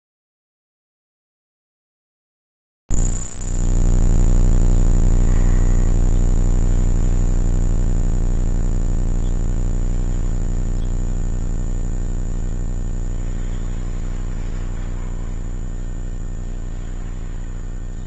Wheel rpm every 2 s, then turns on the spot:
0, 0, 0, 10, 0, 0, 0, 0, 0.
6-8